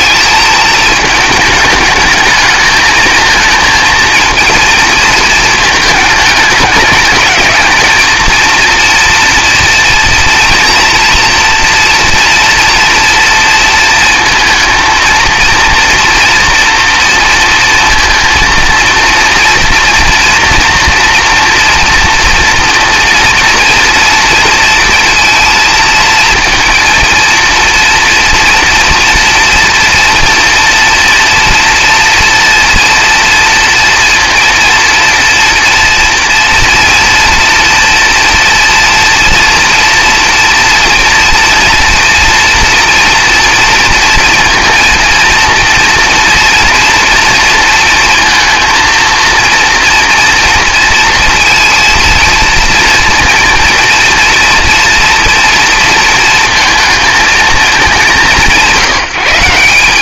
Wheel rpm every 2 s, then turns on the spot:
220, 220, 230, 210, 230, 230, 230, 230, 240, 230, 240, 230, 230, 230, 230, 230, 230, 230, 230, 240, 230, 230, 230, 240, 230, 230, 230, 230, 230, 180.
none